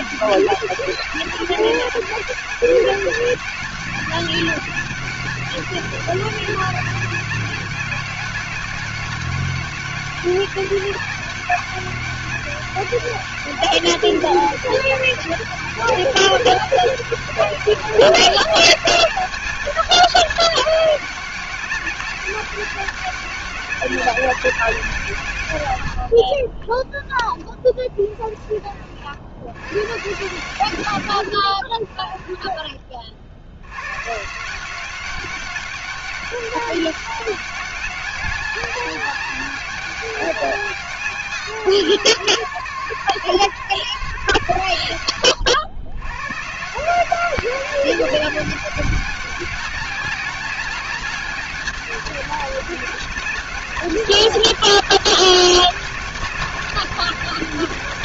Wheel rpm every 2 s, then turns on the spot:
200, 200, 200, 200, 190, 200, 200, 200, 200, 200, 190, 200, 160, 10, 60, 100, 50, 190, 200, 200, 190, 120, 100, 180, 200, 200, 200, 200, 200.
26-28